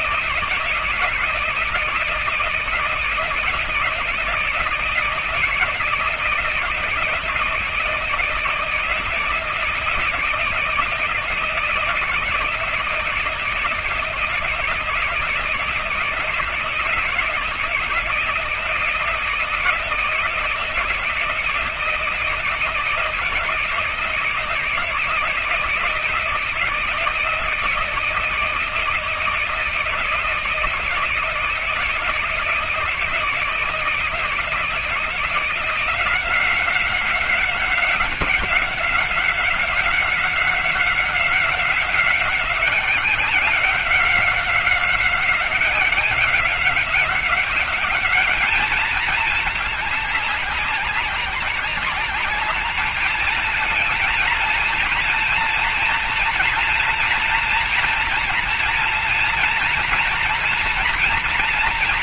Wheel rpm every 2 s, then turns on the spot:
160, 160, 160, 160, 160, 160, 160, 160, 160, 160, 160, 160, 160, 160, 160, 160, 160, 160, 180, 190, 180, 180, 190, 190, 210, 200, 210, 220, 230, 230, 240.
none